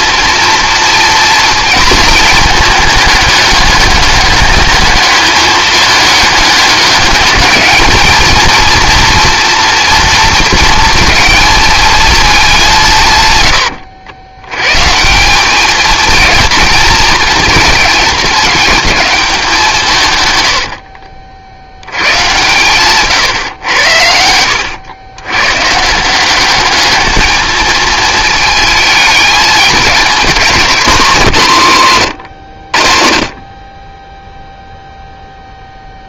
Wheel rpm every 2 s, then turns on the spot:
230, 220, 210, 210, 220, 220, 210, 100, 220, 220, 110, 120, 80, 190, 220, 210, 90, 0.
20-22 24-26